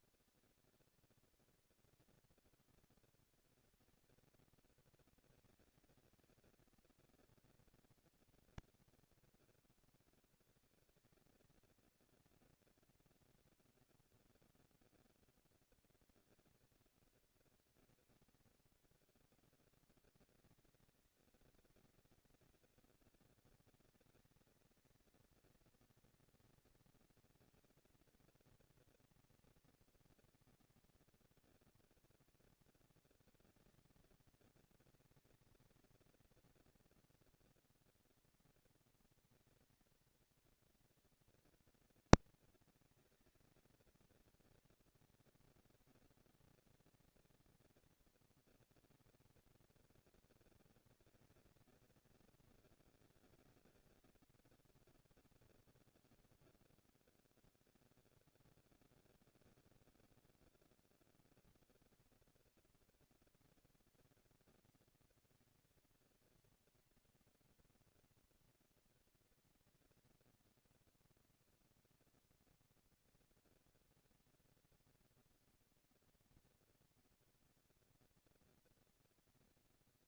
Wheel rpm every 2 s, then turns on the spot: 230, 230, 230, 220, 220, 230, 230, 230, 230, 220, 200, 200, 220, 230, 230, 230, 230, 230, 230, 230, 230, 230, 230, 230, 230, 230, 220, 140, 50, 10, 30, 200, 230, 230, 240, 230, 230, 240, 230, 230.
58-60